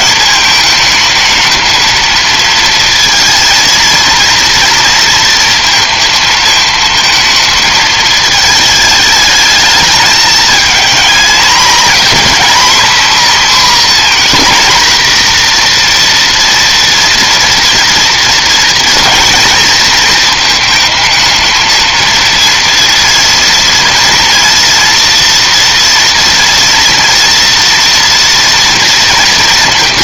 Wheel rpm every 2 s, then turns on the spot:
220, 230, 230, 220, 220, 220, 260, 250, 240, 230, 220, 230, 230, 230, 230.
none